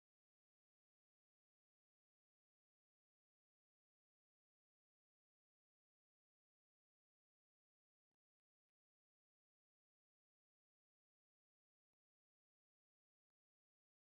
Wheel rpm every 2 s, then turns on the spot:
0, 0, 0, 0, 0, 0, 0.
none